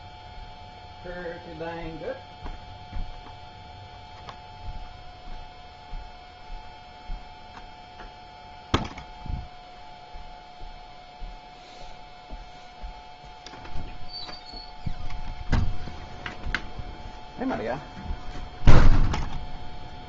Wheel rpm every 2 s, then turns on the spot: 0, 0, 0, 0, 0, 0, 0, 0, 0, 0.
none